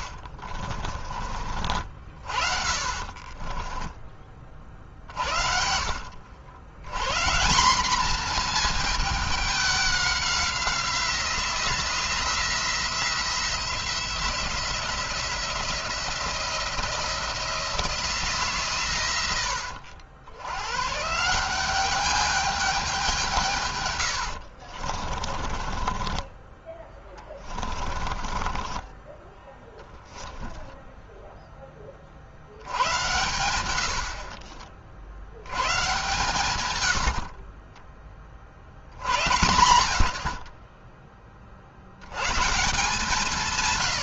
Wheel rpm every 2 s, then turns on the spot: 50, 40, 40, 120, 220, 180, 170, 170, 170, 130, 120, 200, 60, 20, 20, 0, 80, 40, 90, 60, 50, 160.
0-4 24-30